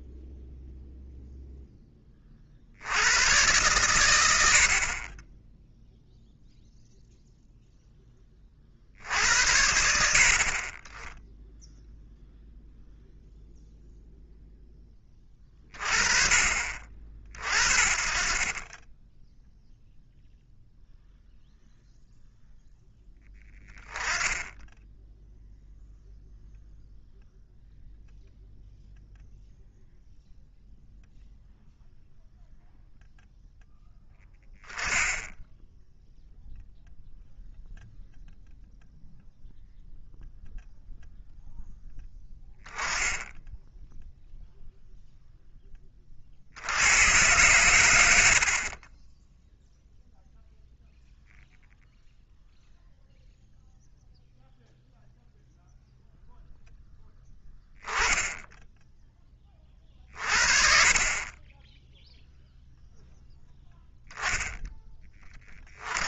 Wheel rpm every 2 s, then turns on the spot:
0, 80, 40, 0, 60, 20, 0, 10, 40, 20, 0, 0, 10, 0, 0, 0, 0, 10, 0, 0, 0, 10, 0, 80, 30, 0, 0, 0, 0, 10, 40, 0, 10.
none